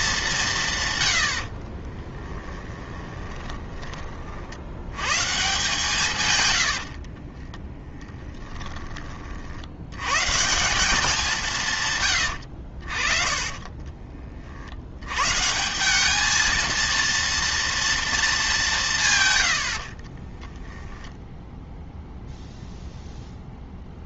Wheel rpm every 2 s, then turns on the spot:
150, 20, 80, 90, 10, 180, 70, 70, 230, 180, 10, 0.
2-4 6-10 12-14 20-22